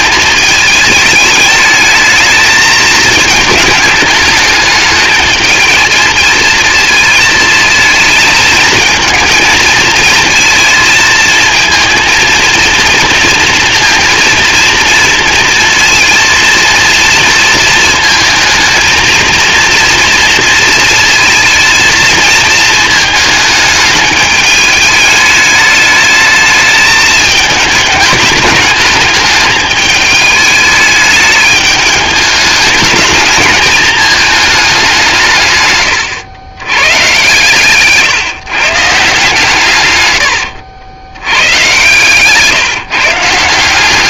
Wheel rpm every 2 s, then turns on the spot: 210, 220, 220, 220, 220, 220, 230, 230, 230, 230, 230, 220, 210, 210, 210, 210, 210, 150, 120, 150, 100, 150.
36-38